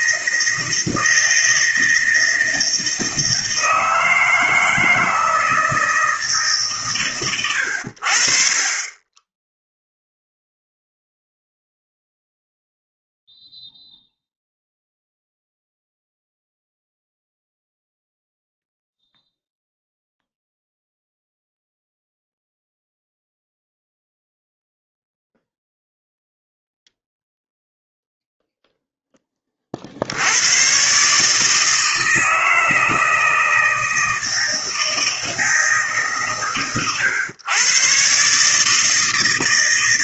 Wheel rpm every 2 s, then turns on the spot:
160, 160, 160, 140, 30, 0, 0, 0, 0, 0, 0, 0, 0, 0, 10, 130, 160, 160, 110, 150.
none